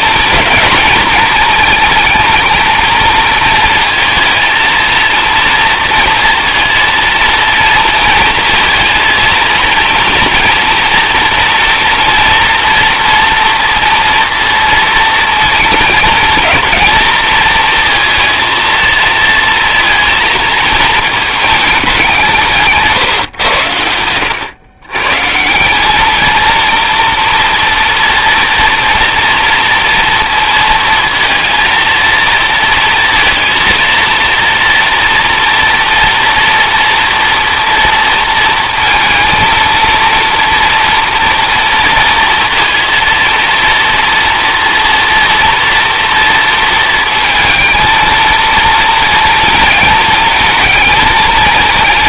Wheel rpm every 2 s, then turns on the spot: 210, 230, 230, 230, 230, 240, 240, 230, 230, 230, 220, 150, 120, 230, 230, 230, 230, 230, 230, 230, 230, 230, 230, 230, 230, 220.
22-24